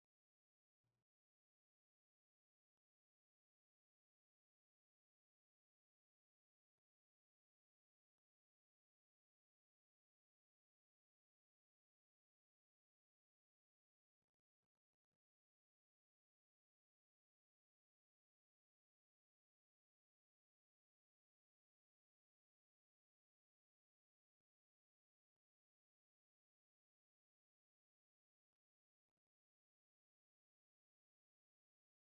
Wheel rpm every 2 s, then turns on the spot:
0, 0, 0, 0, 0, 0, 0, 0, 0, 0, 0, 0, 0, 0, 0, 0.
none